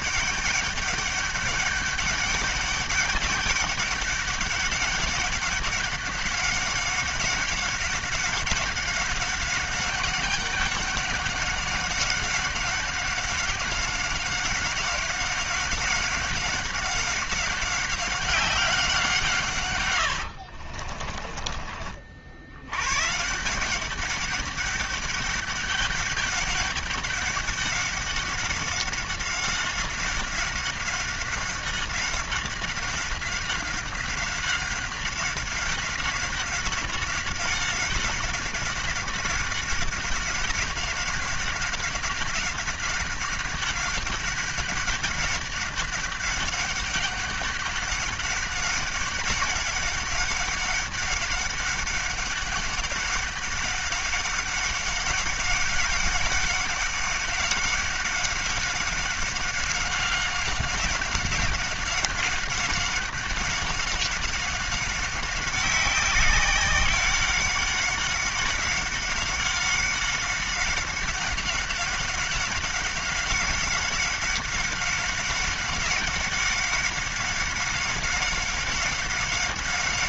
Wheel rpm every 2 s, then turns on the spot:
200, 200, 200, 200, 200, 190, 190, 190, 190, 190, 70, 90, 200, 200, 190, 190, 190, 190, 190, 190, 190, 190, 190, 200, 190, 190, 200, 190, 200, 190, 190, 190, 190, 190, 190, 190, 190, 190, 190, 190.
20-22